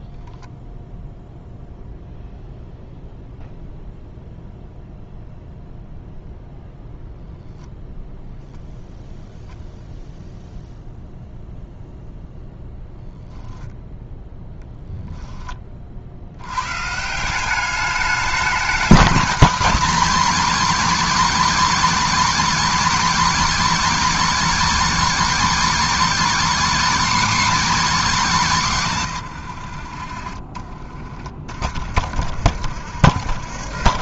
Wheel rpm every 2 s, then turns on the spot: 0, 0, 0, 0, 0, 0, 10, 50, 200, 250, 260, 270, 270, 240, 60, 50, 80.
none